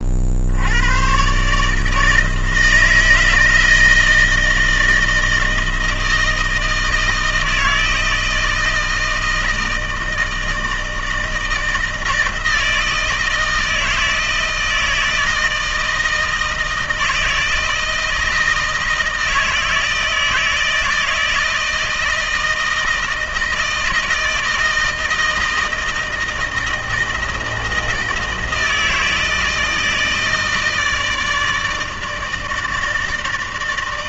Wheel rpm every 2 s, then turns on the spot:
100, 160, 160, 160, 160, 160, 160, 160, 160, 160, 160, 160, 160, 160, 160, 160, 160.
none